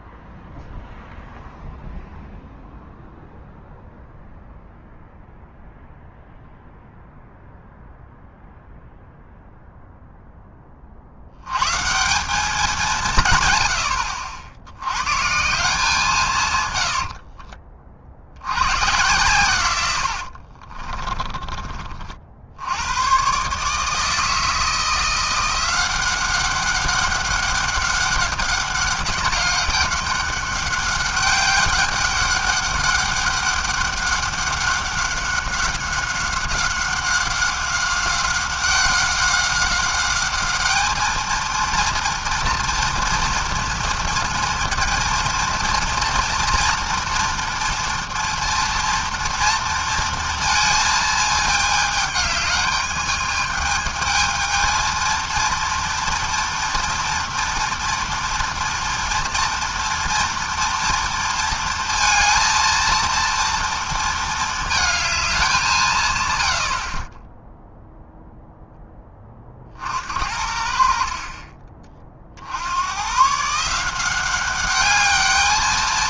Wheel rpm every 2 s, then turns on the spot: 0, 0, 0, 0, 0, 10, 190, 70, 150, 90, 50, 80, 160, 190, 200, 200, 200, 190, 190, 190, 210, 230, 230, 230, 240, 230, 220, 230, 240, 230, 240, 230, 220, 90, 0, 70, 70, 190.
20-22